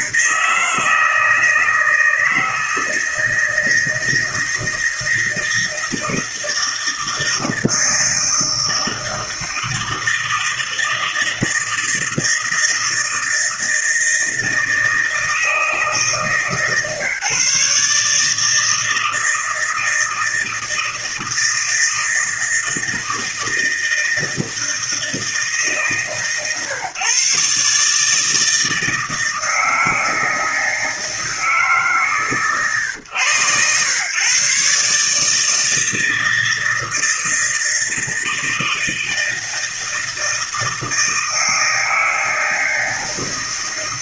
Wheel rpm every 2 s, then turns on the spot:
160, 160, 160, 160, 160, 160, 160, 160, 150, 160, 160, 160, 160, 140, 160, 160, 130, 130, 160, 160, 160, 160.
none